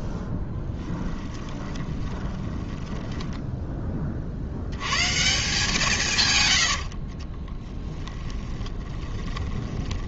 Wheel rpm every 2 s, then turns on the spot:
10, 10, 60, 100, 20.
2-4 8-10